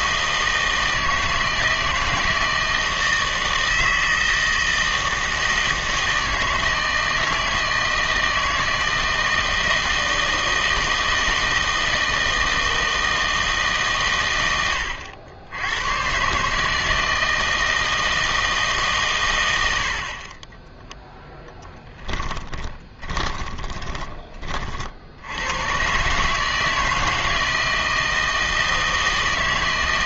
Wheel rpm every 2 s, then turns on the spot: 160, 160, 160, 160, 160, 160, 160, 90, 160, 150, 10, 20, 50, 160, 160.
20-24